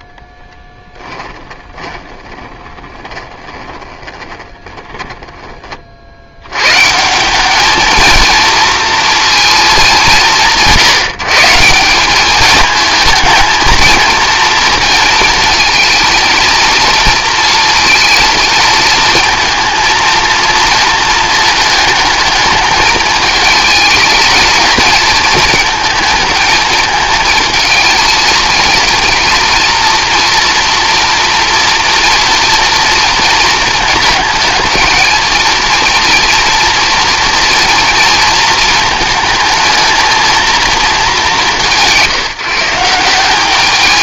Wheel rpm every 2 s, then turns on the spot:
10, 30, 10, 140, 230, 160, 220, 230, 230, 230, 230, 210, 220, 220, 230, 240, 230, 230, 230, 220, 220, 170.
0-6